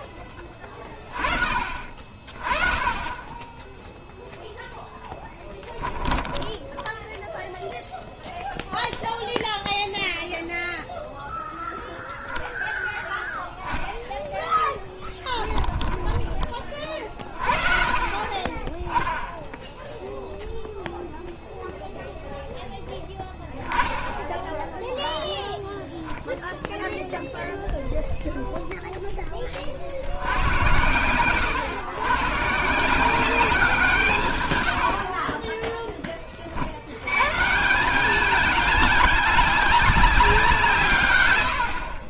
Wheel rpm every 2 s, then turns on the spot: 20, 20, 0, 10, 0, 0, 10, 10, 30, 20, 0, 0, 0, 0, 0, 100, 140, 110, 60, 210, 160.
6-8 14-16